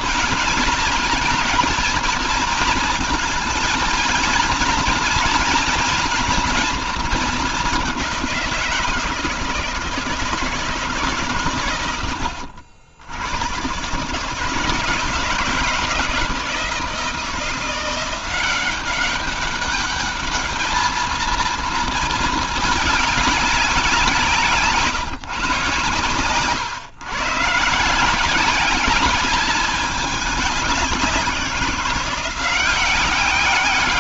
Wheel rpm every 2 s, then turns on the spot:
230, 220, 220, 220, 170, 150, 80, 160, 170, 190, 220, 210, 150, 120, 200, 190, 190.
none